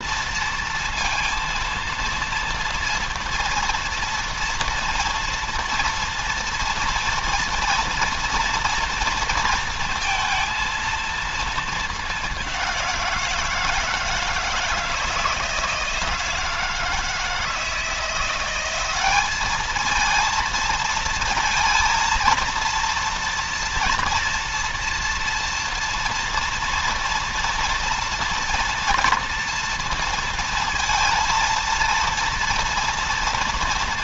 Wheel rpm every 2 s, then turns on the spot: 230, 230, 230, 230, 230, 230, 180, 160, 160, 190, 220, 230, 230, 230, 230, 230, 230.
none